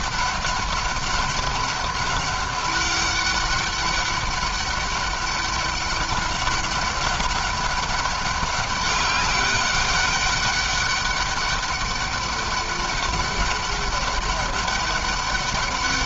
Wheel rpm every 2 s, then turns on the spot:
200, 200, 200, 200, 200, 200, 200, 190.
none